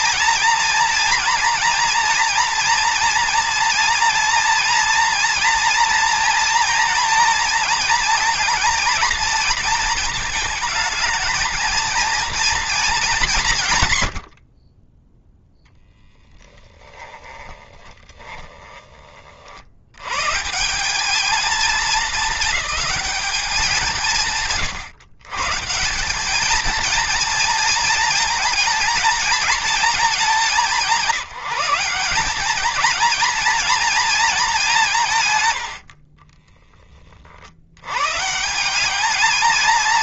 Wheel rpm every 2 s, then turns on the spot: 240, 230, 230, 230, 230, 220, 210, 30, 10, 30, 200, 210, 120, 220, 220, 170, 220, 180, 30, 190.
16-18